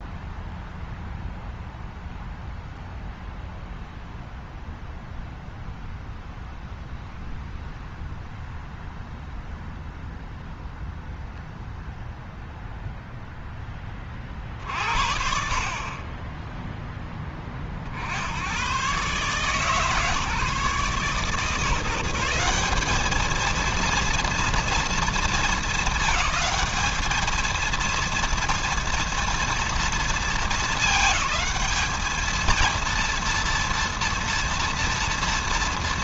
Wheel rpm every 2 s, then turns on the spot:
0, 0, 0, 0, 0, 0, 0, 50, 10, 100, 140, 190, 230, 210, 230, 220, 230, 230.
none